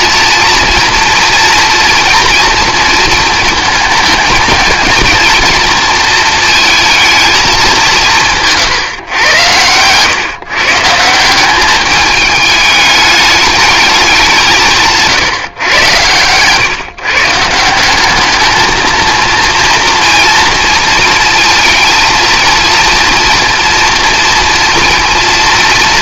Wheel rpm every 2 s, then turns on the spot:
230, 230, 220, 230, 150, 140, 210, 170, 130, 210, 230, 230, 240.
8-10